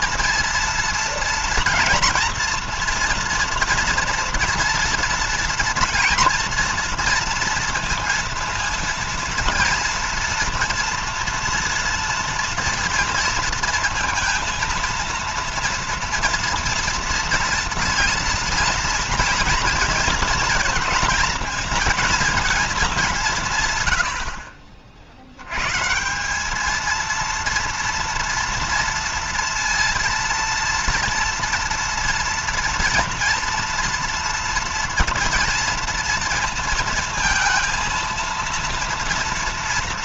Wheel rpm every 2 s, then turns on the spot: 230, 230, 230, 230, 230, 240, 230, 230, 230, 230, 230, 190, 60, 210, 230, 230, 240, 230, 230, 230.
none